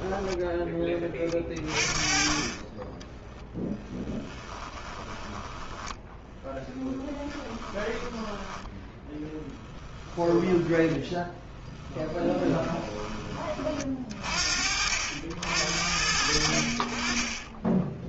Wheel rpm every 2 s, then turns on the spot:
30, 20, 10, 0, 10, 10, 20, 70, 70.
4-6 8-14